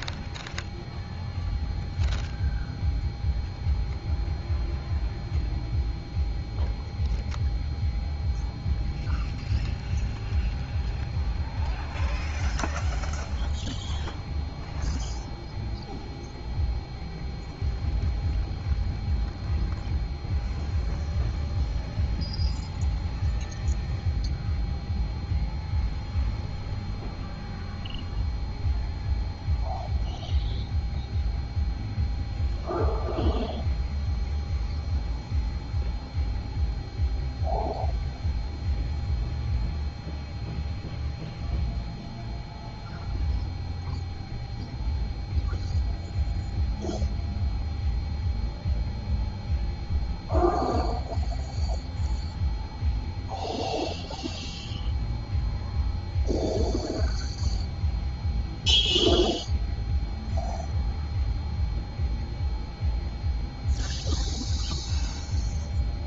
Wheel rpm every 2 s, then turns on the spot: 0, 0, 0, 0, 0, 0, 0, 0, 0, 0, 0, 0, 0, 0, 0, 0, 0, 0, 0, 0, 0, 0, 0, 0, 0, 0, 0, 0, 0, 0, 0, 0, 0.
none